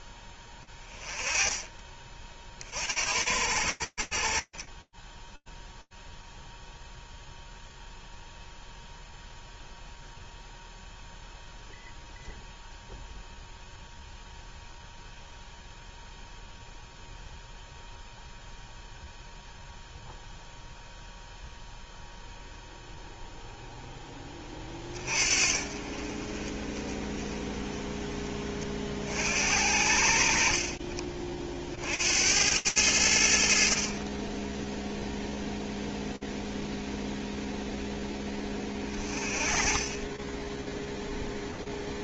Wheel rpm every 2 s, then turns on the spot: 20, 70, 0, 0, 0, 0, 0, 0, 0, 0, 0, 10, 40, 20, 60, 60, 40, 0, 20, 10, 0.
0-2